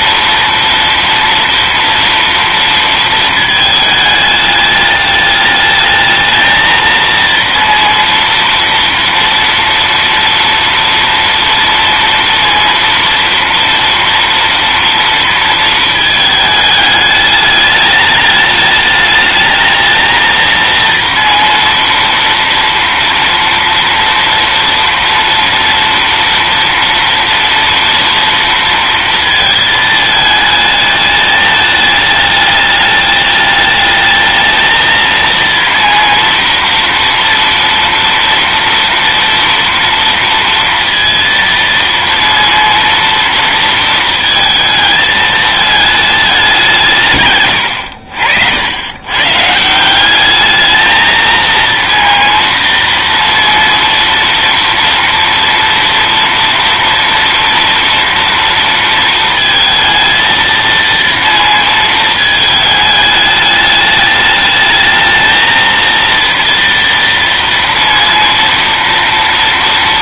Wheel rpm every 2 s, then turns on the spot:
240, 230, 210, 230, 230, 230, 230, 230, 210, 210, 230, 230, 230, 230, 230, 220, 210, 220, 230, 230, 230, 230, 220, 180, 80, 220, 230, 230, 240, 230, 230, 210, 220, 230, 230.
none